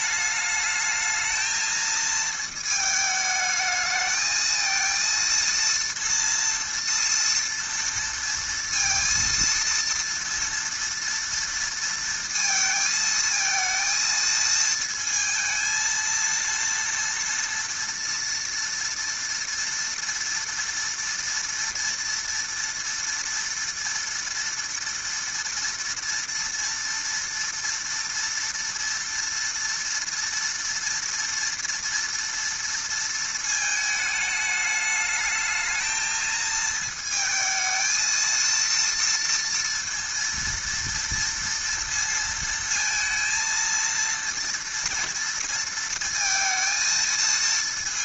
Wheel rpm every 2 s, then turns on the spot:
210, 220, 220, 230, 230, 230, 230, 220, 230, 230, 230, 230, 230, 230, 230, 230, 230, 210, 220, 230, 230, 230, 230, 230.
none